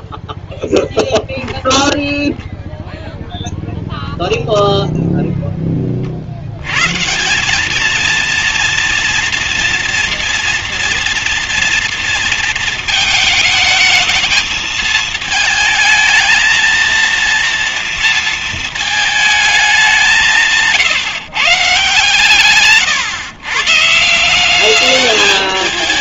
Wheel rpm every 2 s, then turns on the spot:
10, 0, 0, 120, 230, 230, 220, 220, 230, 220, 140, 140, 200.
0-2